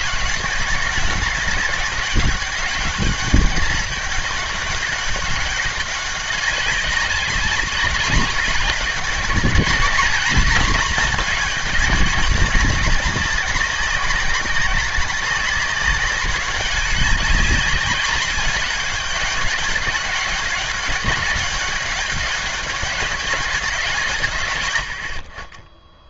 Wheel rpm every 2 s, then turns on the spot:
190, 200, 200, 200, 200, 220, 200, 200, 190, 210, 200, 200, 110.
none